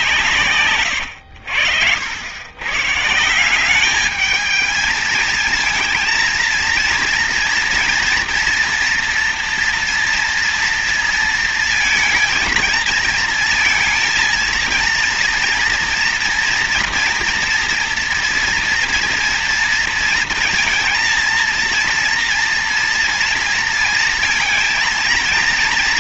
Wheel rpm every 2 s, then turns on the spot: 120, 130, 220, 230, 230, 230, 220, 230, 230, 230, 230, 230, 230.
0-2